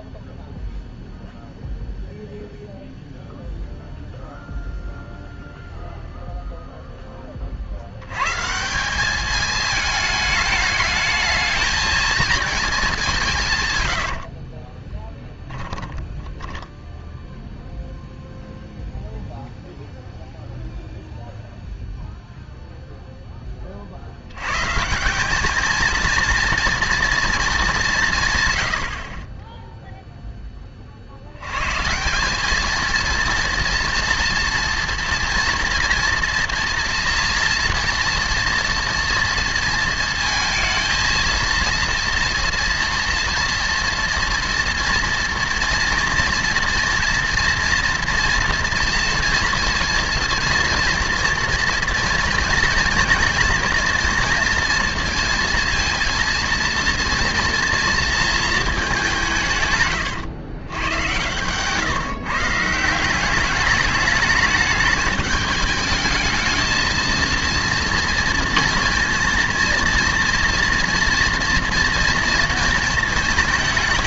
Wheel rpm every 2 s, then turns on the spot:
0, 0, 0, 0, 160, 220, 220, 30, 10, 0, 0, 0, 130, 230, 100, 20, 210, 230, 230, 230, 230, 230, 230, 240, 230, 230, 230, 230, 230, 210, 100, 160, 210, 220, 230, 230, 220.
14-18